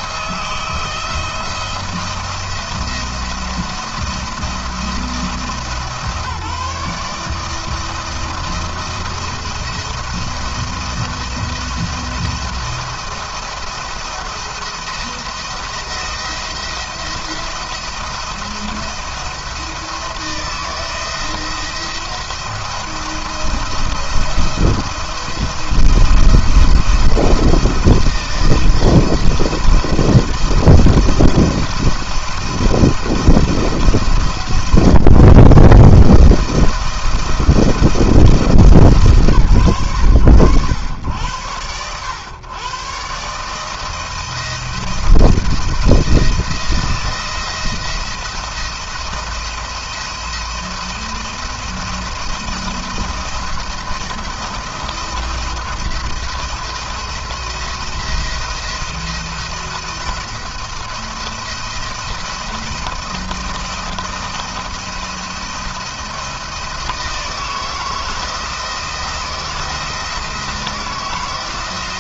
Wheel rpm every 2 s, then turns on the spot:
160, 170, 170, 150, 160, 160, 170, 170, 170, 170, 160, 170, 160, 170, 160, 160, 170, 140, 160, 160, 100, 120, 170, 170, 170, 170, 170, 170, 170, 170, 170, 170, 170, 170, 170, 170.
none